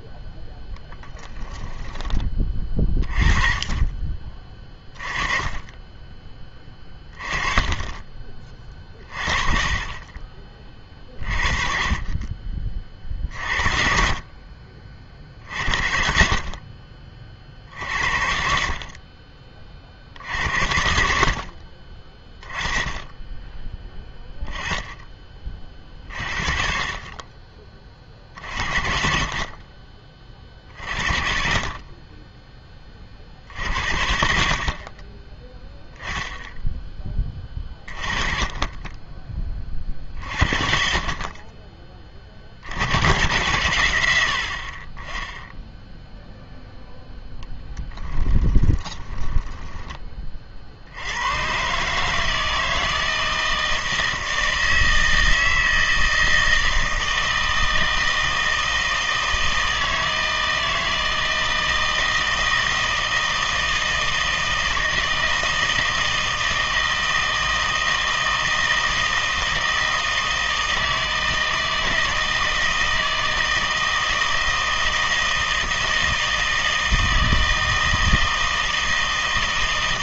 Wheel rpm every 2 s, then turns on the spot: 10, 30, 20, 20, 30, 40, 30, 50, 50, 50, 70, 20, 10, 40, 50, 50, 20, 40, 10, 20, 50, 80, 40, 0, 20, 70, 160, 160, 160, 160, 160, 160, 160, 160, 160, 160, 160, 160, 160, 160.
48-50